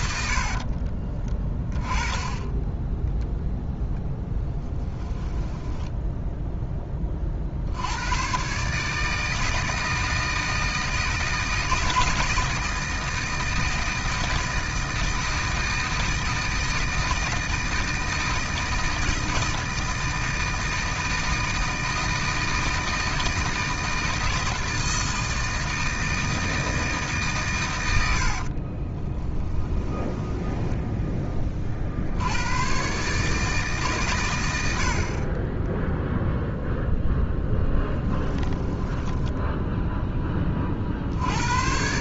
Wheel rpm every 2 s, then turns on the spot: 40, 10, 10, 20, 150, 160, 160, 160, 160, 160, 160, 160, 160, 160, 30, 10, 130, 60, 0, 10, 50.
0-2 4-6 28-32 38-40